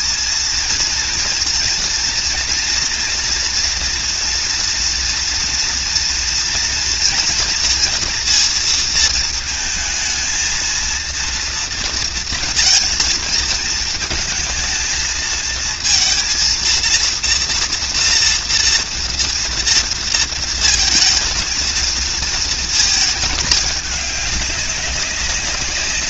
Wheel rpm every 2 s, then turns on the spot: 230, 230, 240, 230, 230, 230, 230, 220, 230, 230, 230, 220, 200.
none